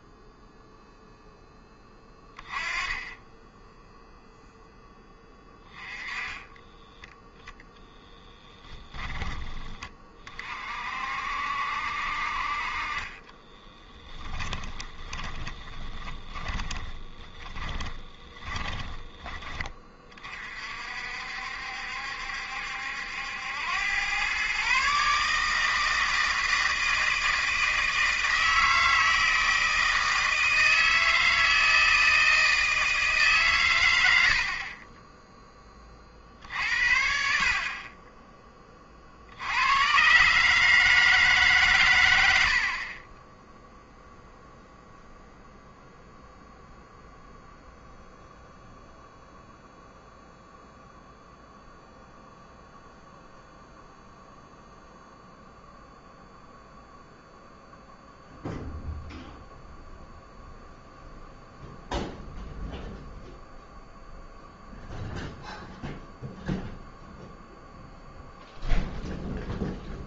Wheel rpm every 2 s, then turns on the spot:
0, 10, 10, 10, 10, 50, 40, 20, 10, 10, 50, 70, 140, 160, 160, 160, 160, 30, 60, 30, 150, 50, 0, 0, 0, 0, 0, 0, 0, 0, 0, 0, 0, 0, 0.
6-8 14-20